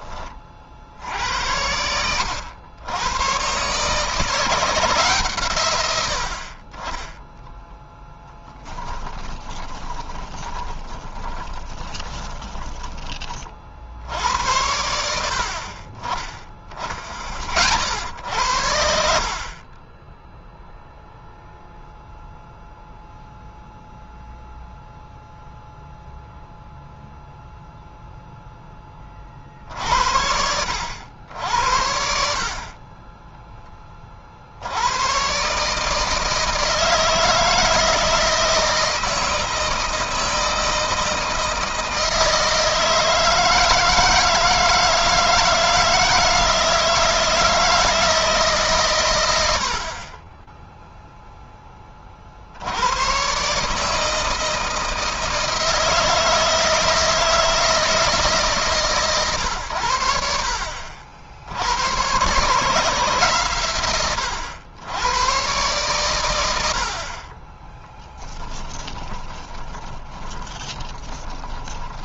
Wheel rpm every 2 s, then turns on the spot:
60, 100, 160, 30, 10, 20, 30, 80, 30, 70, 0, 0, 0, 0, 20, 70, 30, 90, 160, 160, 160, 160, 160, 160, 130, 0, 90, 160, 160, 130, 70, 160, 110, 70, 20, 20.
8-14 68-72